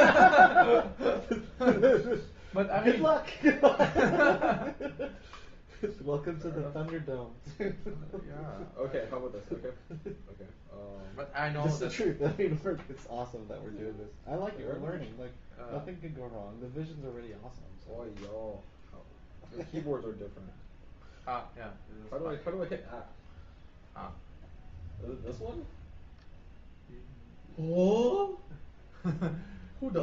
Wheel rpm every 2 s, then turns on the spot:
0, 0, 0, 0, 0, 0, 0, 0, 0, 0, 0, 0, 0, 0, 0.
none